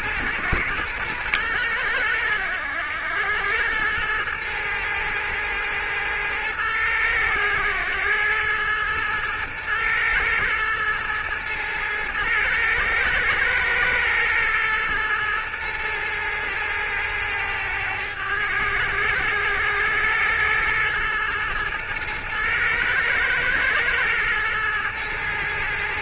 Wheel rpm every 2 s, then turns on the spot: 110, 90, 110, 110, 110, 110, 110, 120, 110, 100, 110, 120, 110.
none